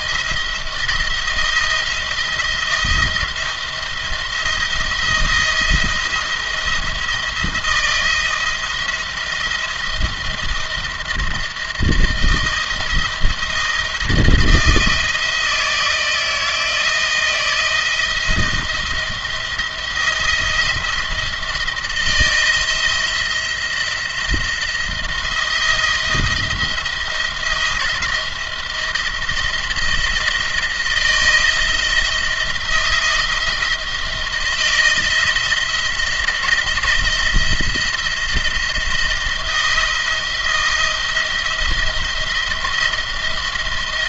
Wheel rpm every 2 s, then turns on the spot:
170, 170, 170, 170, 170, 160, 160, 160, 160, 170, 170, 170, 170, 170, 170, 170, 170, 160, 160, 170, 170, 170.
none